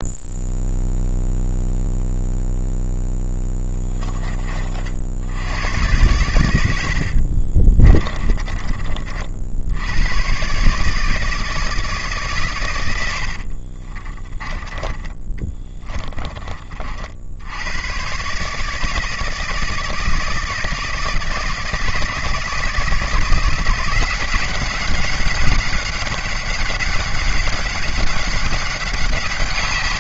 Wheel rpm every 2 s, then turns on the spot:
0, 0, 50, 80, 50, 150, 90, 20, 40, 160, 160, 150, 190, 200, 180.
6-8 14-16